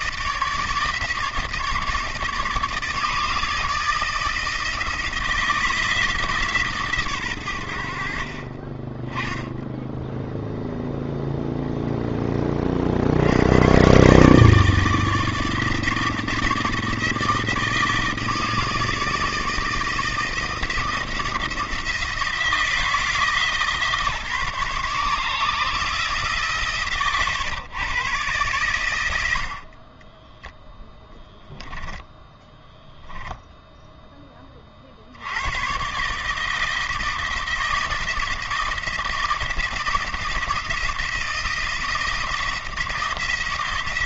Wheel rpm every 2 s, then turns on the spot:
150, 150, 160, 140, 20, 0, 30, 160, 160, 160, 170, 170, 140, 130, 100, 10, 0, 50, 160, 160, 170, 170.
none